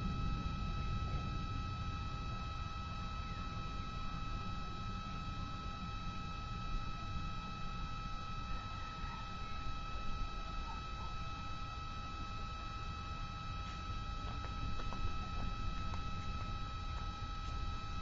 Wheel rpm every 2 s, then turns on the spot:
0, 0, 0, 0, 0, 0, 0, 0, 0.
none